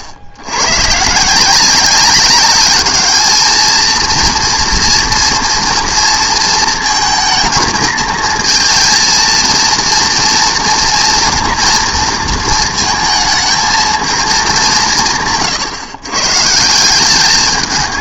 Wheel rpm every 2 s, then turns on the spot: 90, 200, 230, 230, 220, 230, 220, 200, 160.
none